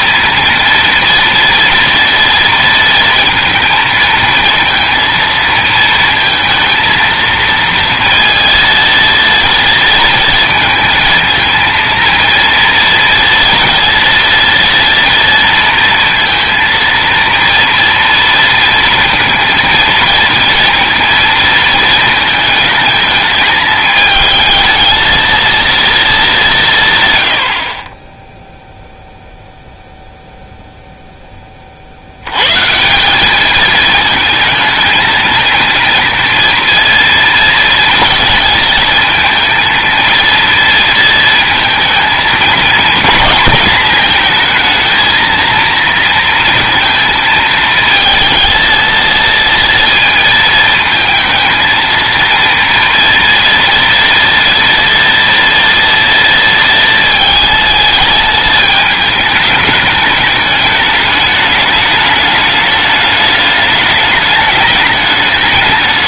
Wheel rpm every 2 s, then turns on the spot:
230, 230, 230, 230, 230, 220, 230, 230, 230, 230, 230, 220, 220, 160, 0, 0, 160, 220, 230, 220, 230, 220, 230, 230, 230, 220, 230, 230, 220, 210, 210, 210, 210.
none